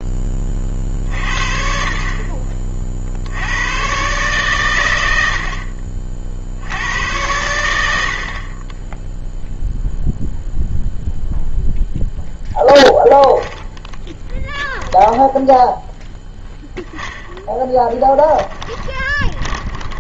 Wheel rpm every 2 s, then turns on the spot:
40, 40, 130, 80, 20, 0, 0, 10, 10, 10.
18-20